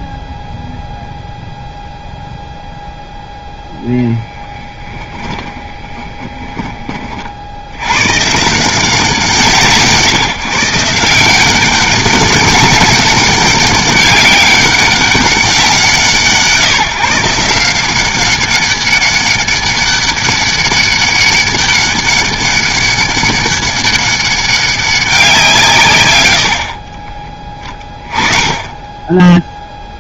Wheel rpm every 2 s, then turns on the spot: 0, 0, 20, 20, 160, 150, 190, 200, 160, 200, 200, 200, 200, 80, 20.
4-6 28-30